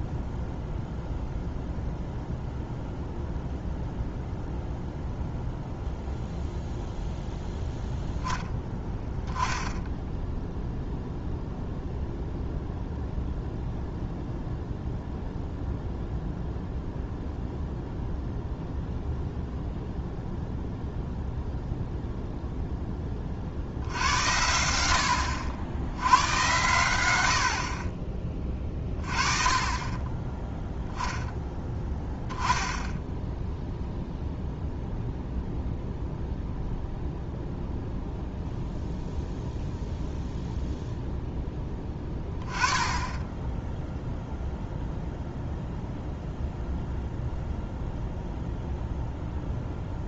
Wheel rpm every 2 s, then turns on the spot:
0, 0, 0, 0, 10, 0, 0, 0, 0, 0, 0, 10, 80, 100, 30, 0, 10, 0, 0, 0, 0, 20, 0, 0, 0.
none